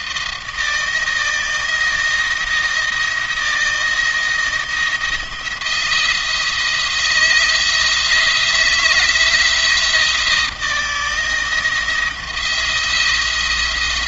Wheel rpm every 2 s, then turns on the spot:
160, 170, 170, 160, 170, 160, 170.
none